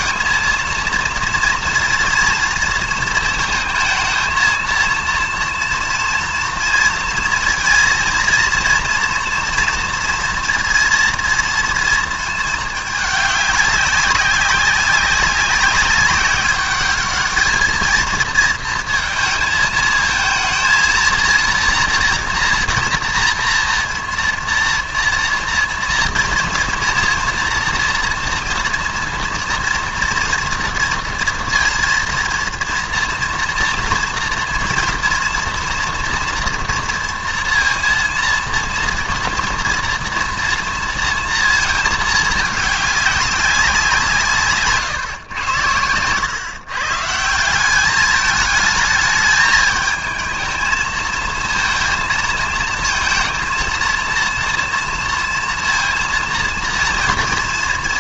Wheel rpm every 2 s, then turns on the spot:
230, 230, 220, 230, 230, 230, 210, 190, 200, 220, 220, 240, 230, 230, 240, 230, 230, 230, 230, 230, 230, 210, 150, 130, 210, 220, 220, 230, 240.
none